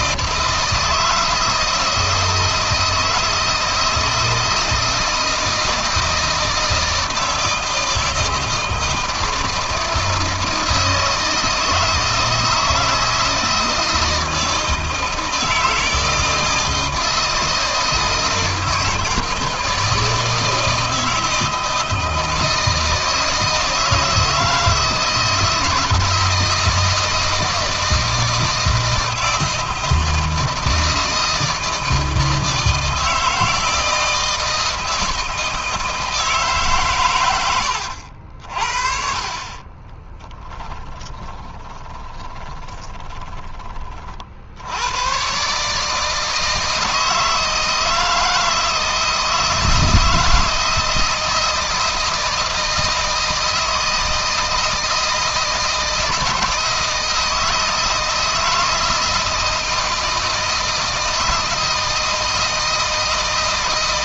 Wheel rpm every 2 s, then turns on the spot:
160, 160, 160, 160, 160, 160, 160, 160, 160, 160, 160, 160, 160, 160, 160, 160, 160, 170, 130, 50, 10, 20, 90, 160, 160, 160, 160, 160, 160, 160, 160, 160.
38-44